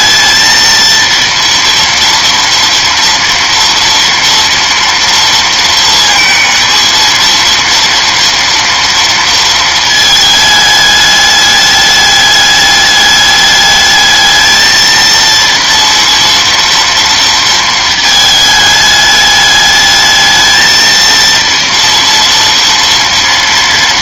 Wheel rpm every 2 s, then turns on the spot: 220, 240, 230, 230, 230, 220, 210, 220, 230, 220, 220, 230.
none